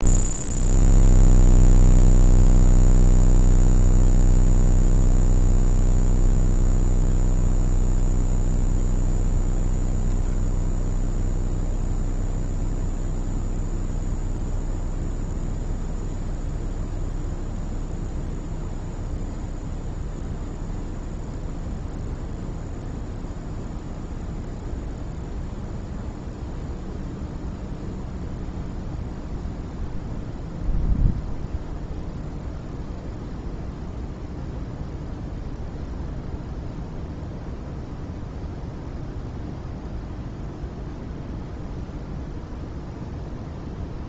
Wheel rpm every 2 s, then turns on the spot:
0, 0, 0, 0, 0, 0, 0, 0, 0, 0, 0, 0, 0, 0, 0, 0, 0, 0, 0, 0, 0, 0.
none